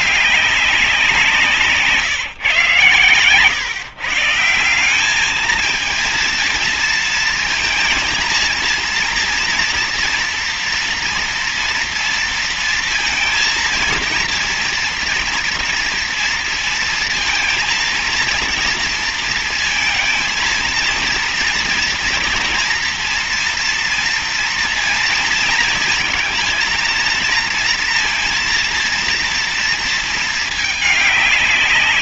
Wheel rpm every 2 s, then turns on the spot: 200, 130, 180, 230, 230, 230, 230, 230, 230, 230, 230, 230, 230, 230, 230, 220.
none